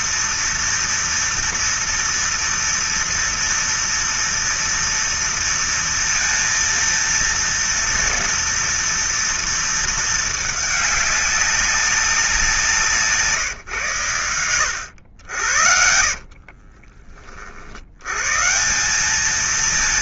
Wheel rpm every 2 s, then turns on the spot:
230, 230, 230, 230, 230, 220, 190, 110, 50, 110.
16-18